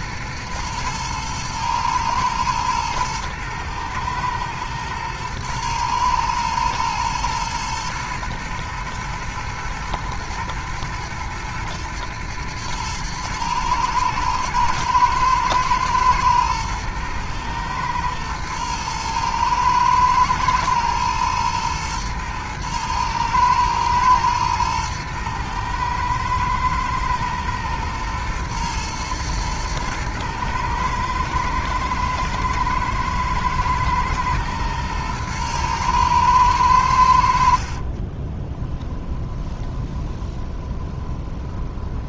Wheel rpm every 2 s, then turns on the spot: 110, 110, 110, 110, 110, 120, 110, 110, 110, 110, 110, 110, 110, 120, 110, 110, 120, 110, 80, 10, 20.
38-42